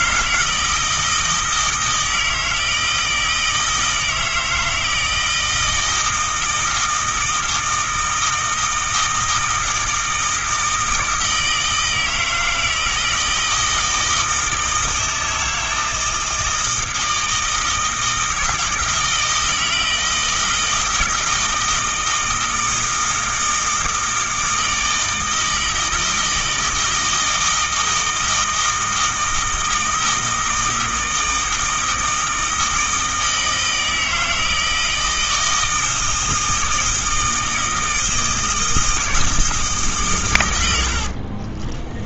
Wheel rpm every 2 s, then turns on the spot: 160, 160, 160, 160, 160, 160, 160, 160, 160, 160, 160, 160, 160, 160, 160, 160, 160, 160, 160, 160, 70.
40-42